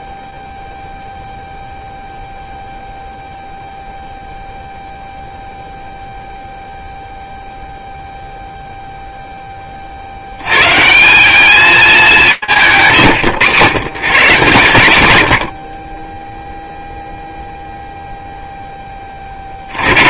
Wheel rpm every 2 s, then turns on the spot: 0, 0, 0, 0, 0, 130, 160, 120, 0, 10.
none